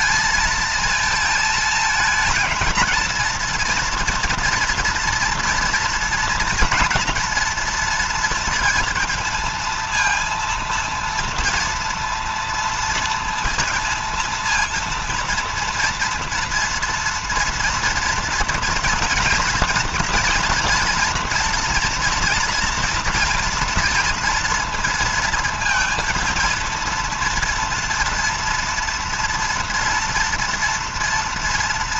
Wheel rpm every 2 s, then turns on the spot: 220, 230, 230, 230, 230, 230, 230, 230, 240, 230, 230, 230, 230, 230, 230, 230.
none